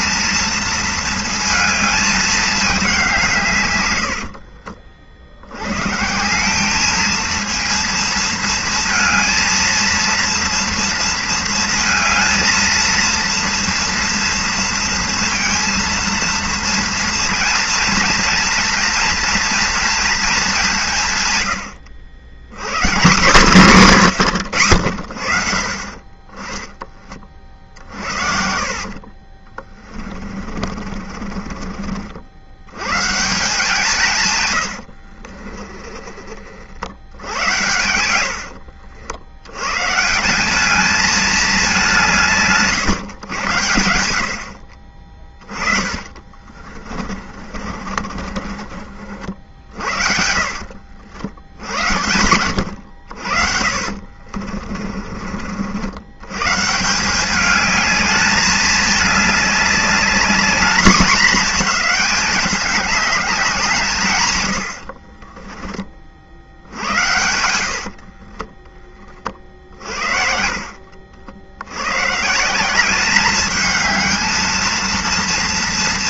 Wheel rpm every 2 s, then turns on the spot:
230, 210, 50, 190, 230, 230, 230, 230, 230, 230, 190, 130, 120, 10, 60, 40, 80, 100, 40, 80, 200, 150, 60, 30, 30, 60, 90, 40, 140, 210, 220, 210, 100, 60, 10, 40, 170, 230.
4-6 28-32 34-36 38-40 46-50 54-56 68-70